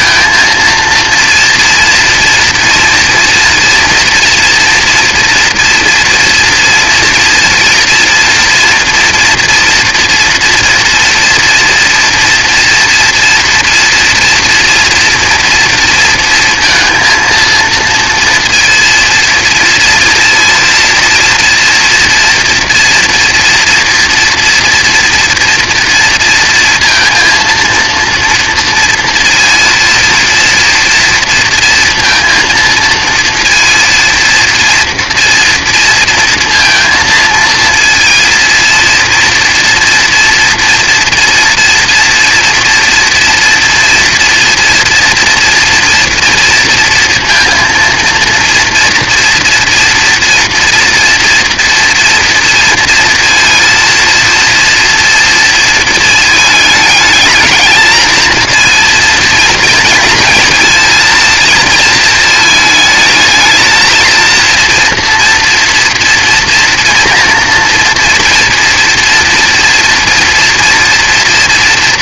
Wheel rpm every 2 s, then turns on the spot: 230, 230, 230, 230, 240, 230, 230, 230, 230, 230, 230, 230, 230, 230, 230, 230, 230, 240, 230, 230, 240, 230, 230, 230, 230, 240, 230, 230, 210, 230, 230, 220, 230, 230, 230, 240.
none